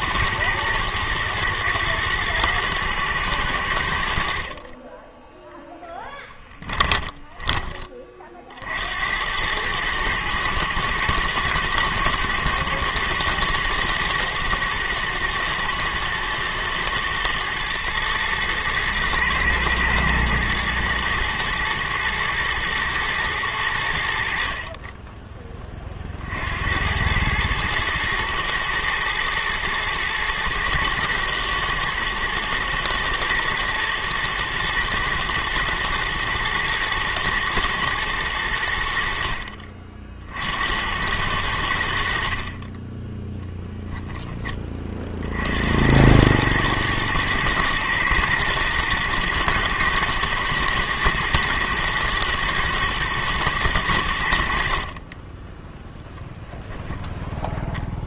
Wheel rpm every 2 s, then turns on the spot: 120, 120, 40, 10, 60, 110, 110, 110, 110, 120, 120, 110, 50, 70, 110, 110, 110, 110, 110, 90, 70, 40, 20, 100, 110, 120, 110, 60, 10.
6-8